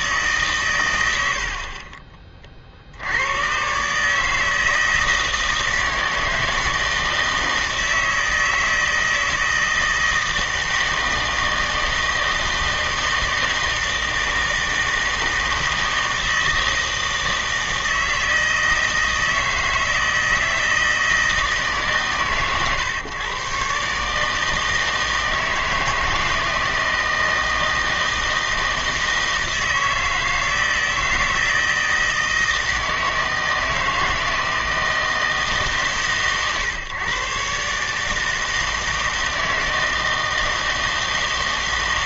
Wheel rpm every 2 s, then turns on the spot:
130, 40, 160, 160, 160, 160, 160, 160, 160, 160, 160, 120, 160, 160, 160, 160, 160, 160, 120, 160, 160.
none